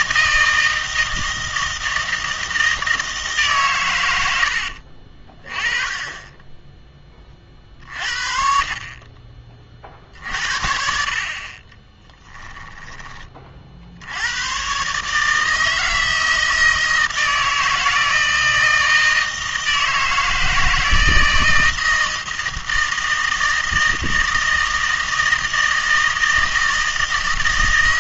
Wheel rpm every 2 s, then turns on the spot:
160, 160, 60, 10, 40, 60, 20, 130, 160, 160, 160, 160, 160, 160.
4-6 12-14